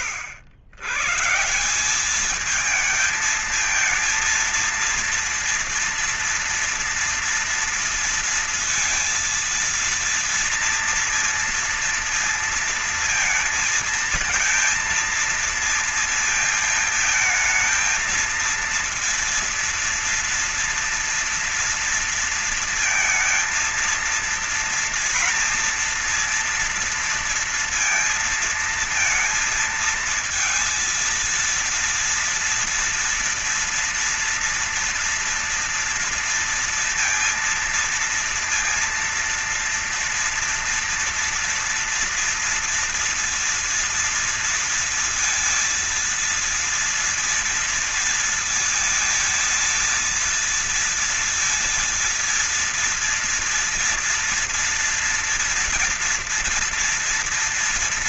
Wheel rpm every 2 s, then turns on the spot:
90, 220, 230, 230, 230, 230, 230, 230, 220, 230, 230, 230, 230, 230, 230, 220, 230, 240, 230, 230, 240, 230, 230, 230, 230, 230, 230, 230, 230.
none